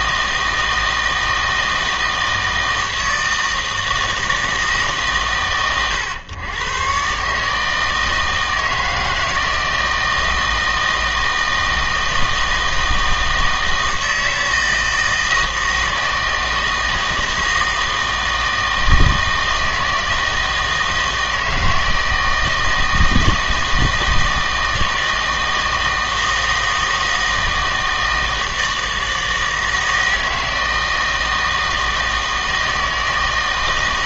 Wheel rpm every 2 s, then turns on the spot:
160, 160, 150, 120, 160, 160, 160, 160, 160, 160, 160, 160, 160, 160, 160, 160, 160.
none